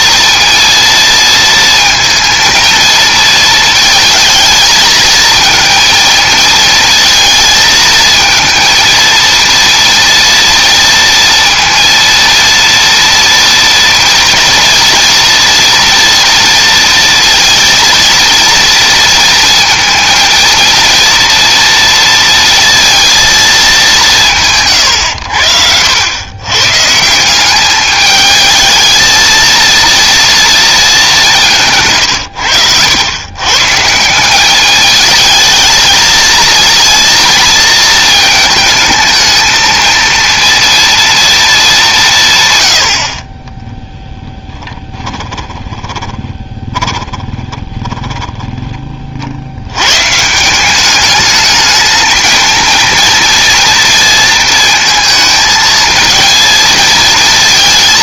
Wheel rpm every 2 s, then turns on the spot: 230, 230, 220, 230, 230, 230, 230, 230, 230, 230, 230, 230, 120, 130, 220, 220, 100, 210, 230, 220, 230, 80, 10, 20, 20, 190, 230, 230, 230.
44-48